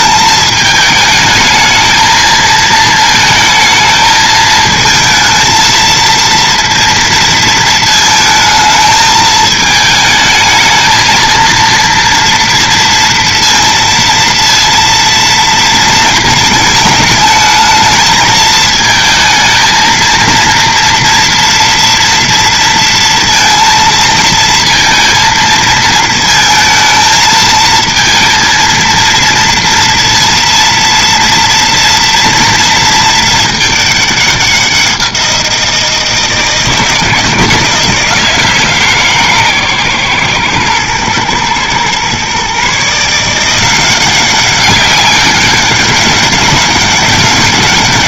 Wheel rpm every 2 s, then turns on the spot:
220, 230, 220, 230, 220, 220, 230, 230, 220, 220, 230, 230, 230, 220, 230, 230, 230, 190, 160, 160, 120, 140, 190, 200.
none